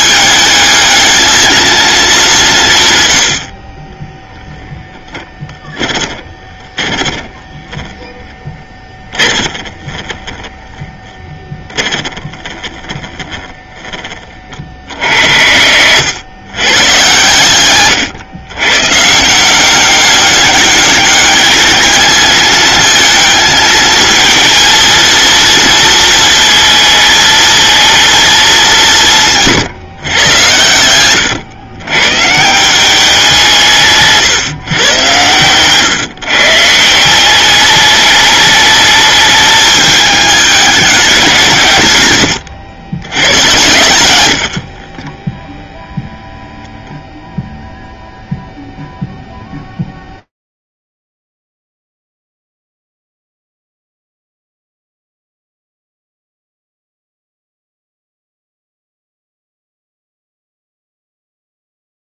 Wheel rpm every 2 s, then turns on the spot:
220, 130, 10, 10, 20, 10, 10, 50, 110, 130, 200, 220, 230, 220, 180, 100, 180, 120, 170, 210, 200, 100, 30, 0, 0, 0, 0, 0, 0, 0, 0.
4-8 44-46